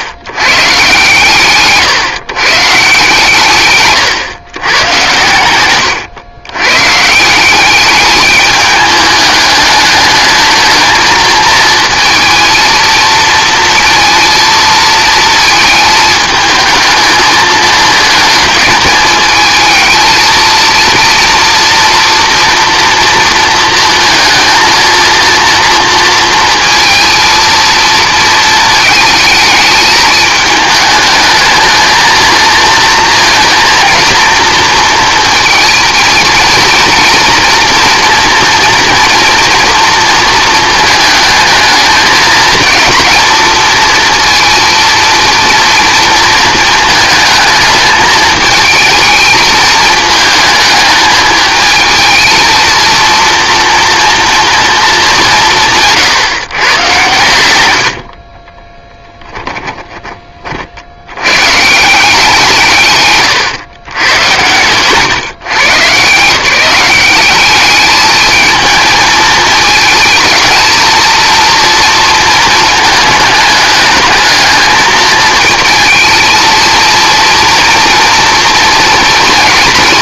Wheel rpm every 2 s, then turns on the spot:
110, 130, 120, 120, 210, 220, 230, 230, 220, 210, 230, 230, 230, 230, 220, 220, 230, 230, 230, 230, 220, 230, 230, 220, 220, 220, 230, 220, 110, 10, 70, 140, 130, 190, 220, 230, 220, 220, 230, 230.
58-60 64-66